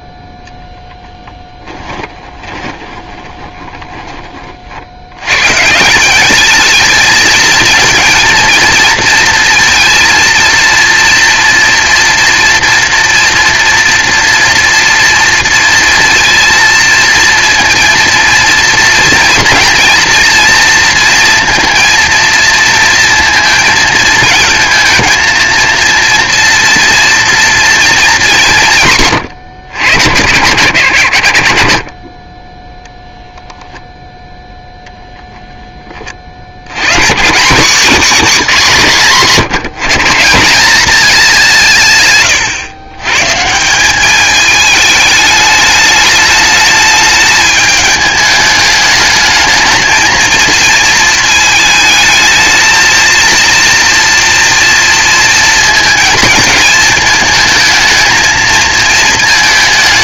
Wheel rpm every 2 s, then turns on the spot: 0, 20, 60, 220, 230, 230, 240, 230, 230, 230, 230, 230, 220, 230, 120, 90, 0, 10, 120, 200, 200, 120, 220, 210, 210, 220, 230, 230, 220, 220.
2-4